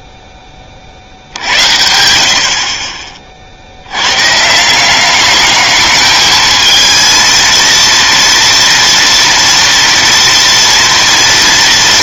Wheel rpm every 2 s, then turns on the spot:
10, 60, 140, 220, 230, 230.
none